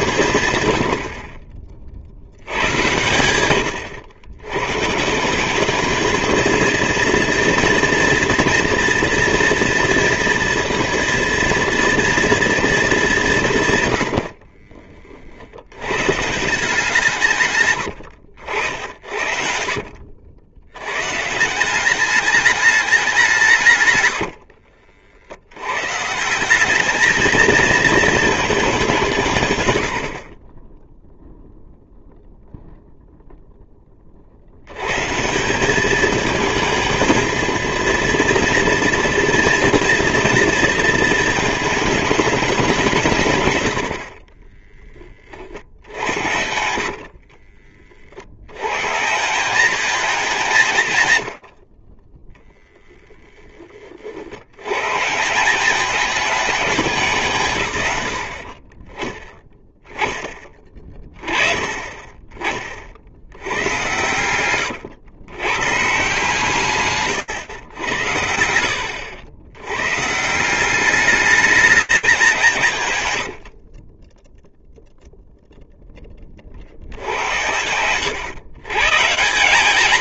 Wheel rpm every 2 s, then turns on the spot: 70, 100, 150, 230, 230, 230, 210, 50, 160, 70, 130, 200, 60, 200, 170, 10, 0, 130, 230, 230, 220, 160, 30, 40, 150, 100, 10, 140, 180, 10, 20, 80, 130, 100, 100, 210, 80, 0, 90, 170.
0-2 18-20 24-26 46-48 72-74 76-78